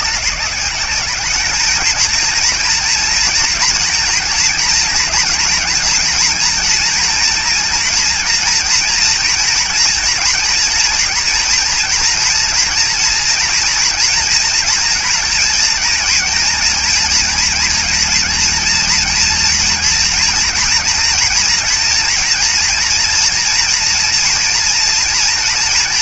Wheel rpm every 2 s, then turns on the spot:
200, 230, 220, 230, 230, 230, 230, 230, 220, 240, 230, 230, 230.
none